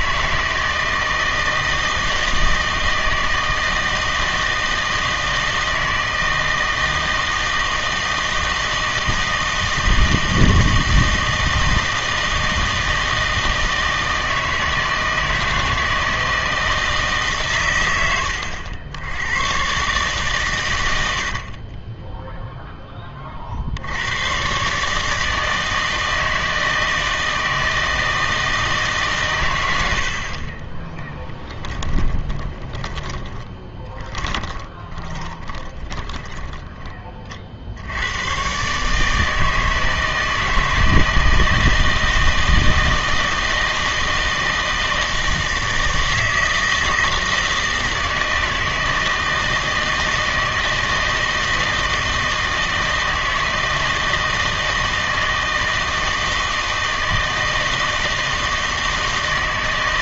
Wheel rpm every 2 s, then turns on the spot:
160, 160, 160, 160, 160, 160, 160, 160, 160, 80, 100, 10, 130, 160, 150, 30, 30, 30, 20, 140, 160, 160, 160, 160, 160, 160, 160, 160, 160, 160.
30-38